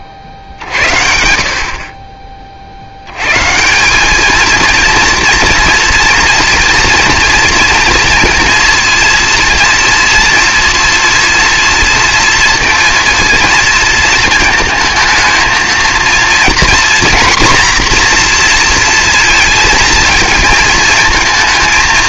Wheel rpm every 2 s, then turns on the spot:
30, 60, 230, 230, 230, 230, 240, 220, 240, 230, 220.
none